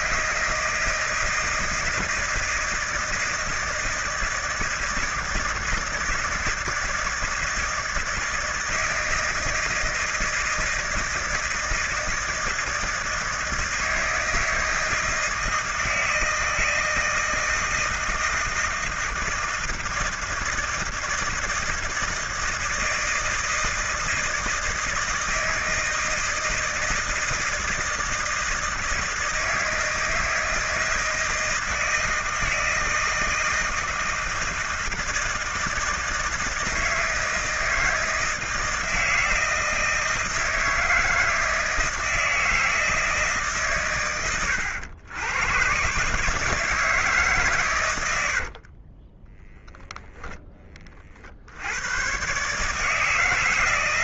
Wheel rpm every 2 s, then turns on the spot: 160, 160, 160, 160, 160, 160, 160, 160, 160, 170, 160, 160, 160, 160, 160, 160, 160, 160, 160, 160, 160, 160, 100, 160, 50, 20, 150.
48-50